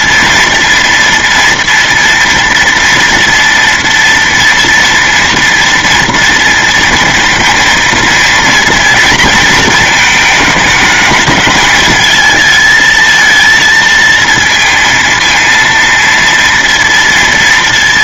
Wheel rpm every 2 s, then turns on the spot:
230, 230, 230, 230, 230, 210, 220, 230, 230.
none